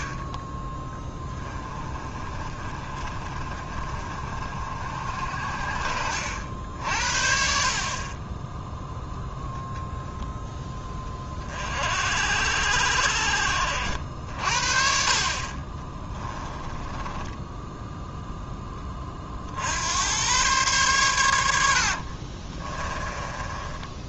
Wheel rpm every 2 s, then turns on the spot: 20, 50, 60, 60, 0, 10, 70, 50, 10, 20, 110, 20.
22-24